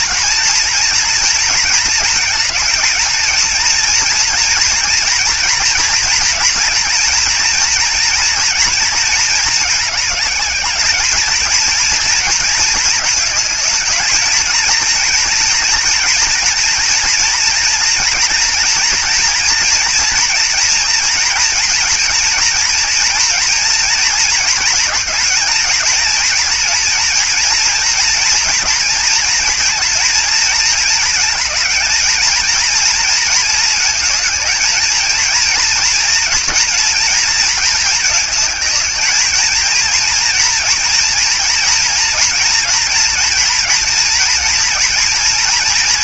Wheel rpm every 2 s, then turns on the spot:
230, 220, 230, 230, 230, 210, 220, 230, 230, 230, 230, 230, 230, 230, 230, 220, 230, 220, 230, 220, 240, 240, 230.
none